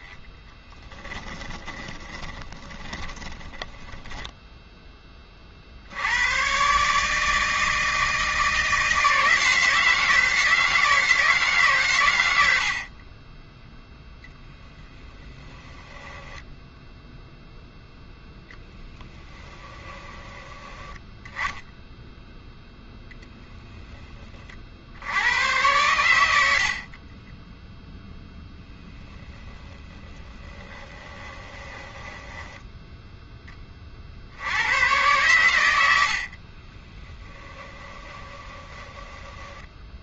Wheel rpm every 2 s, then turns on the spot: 10, 20, 10, 130, 160, 160, 60, 0, 0, 0, 10, 0, 40, 70, 0, 10, 10, 80, 30, 20.
0-4 30-34 36-40